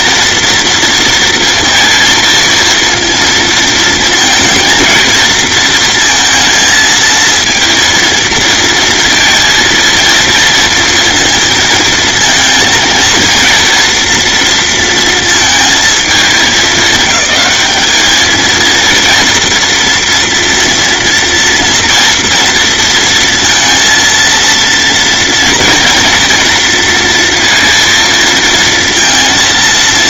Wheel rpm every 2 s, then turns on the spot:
230, 230, 220, 230, 230, 230, 230, 230, 200, 230, 230, 230, 230, 230, 230.
none